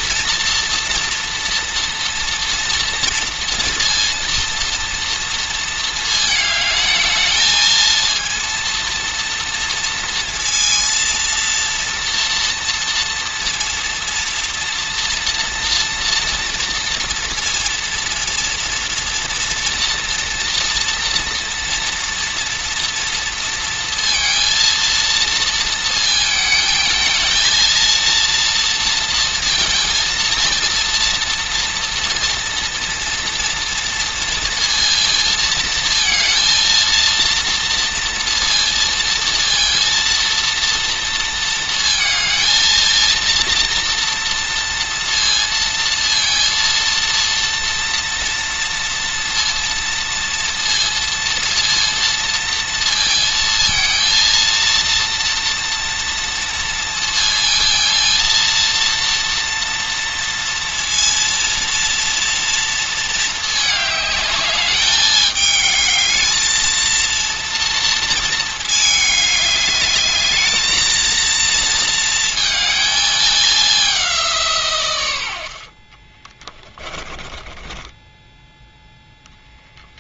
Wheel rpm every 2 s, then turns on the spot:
230, 230, 230, 220, 230, 230, 230, 230, 240, 230, 240, 230, 230, 220, 230, 230, 230, 230, 230, 230, 230, 230, 230, 230, 230, 230, 230, 230, 230, 230, 230, 230, 210, 230, 220, 220, 220, 140, 20, 0.
76-78